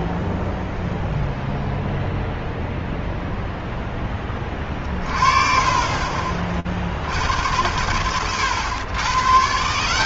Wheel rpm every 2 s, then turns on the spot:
0, 0, 20, 30, 90.
none